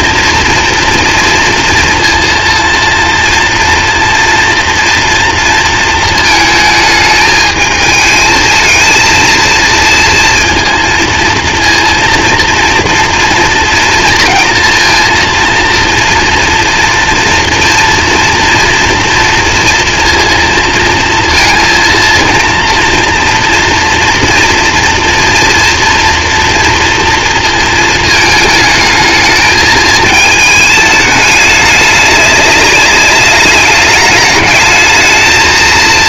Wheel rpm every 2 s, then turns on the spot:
230, 230, 230, 220, 230, 230, 230, 230, 230, 230, 230, 230, 230, 230, 220, 210, 200, 220.
none